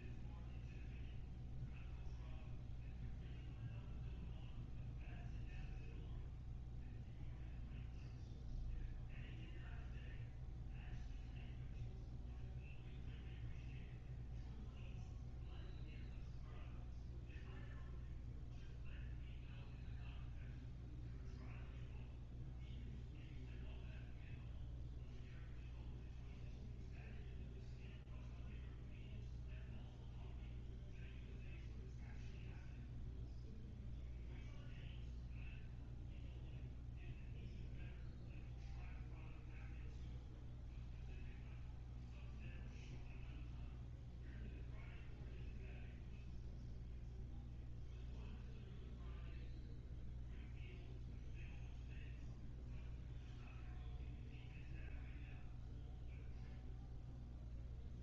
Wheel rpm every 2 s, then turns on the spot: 0, 0, 0, 0, 0, 0, 0, 0, 0, 0, 0, 0, 0, 0, 0, 0, 0, 0, 0, 0, 0, 0, 0, 0, 0, 0, 0, 0, 0.
none